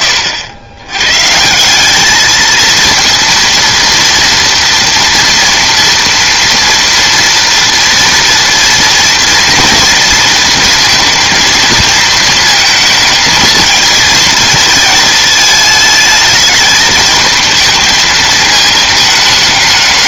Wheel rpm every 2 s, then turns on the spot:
40, 210, 230, 230, 230, 230, 230, 230, 220, 220.
none